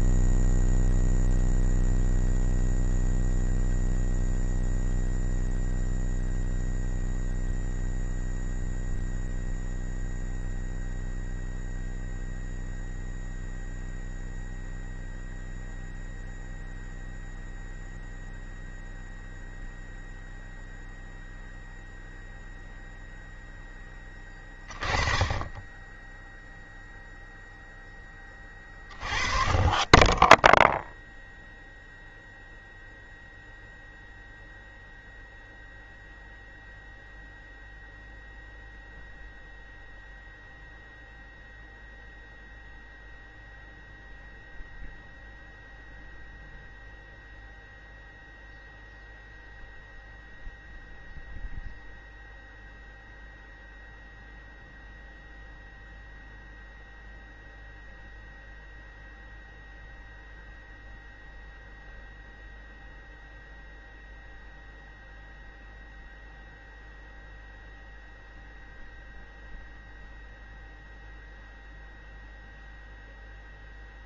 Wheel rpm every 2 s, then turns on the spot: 0, 0, 0, 0, 0, 0, 0, 0, 0, 0, 0, 0, 20, 0, 20, 0, 0, 0, 0, 0, 0, 0, 0, 0, 0, 0, 0, 0, 0, 0, 0, 0, 0, 0, 0, 0, 0.
none